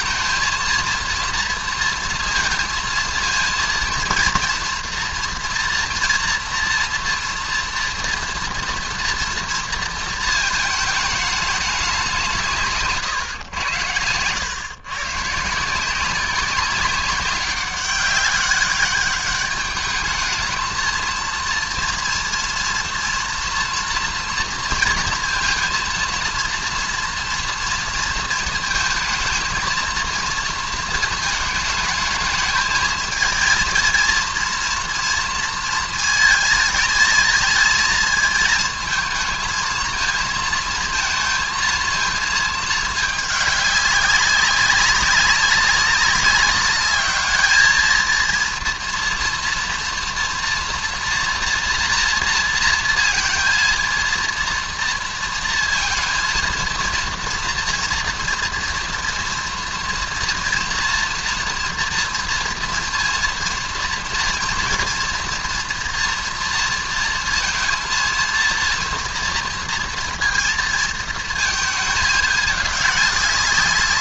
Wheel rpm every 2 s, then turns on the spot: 230, 230, 230, 230, 230, 220, 140, 120, 190, 200, 230, 230, 230, 230, 220, 220, 220, 230, 220, 220, 230, 220, 200, 200, 230, 230, 230, 230, 230, 230, 230, 230, 230, 230, 230, 230, 200.
none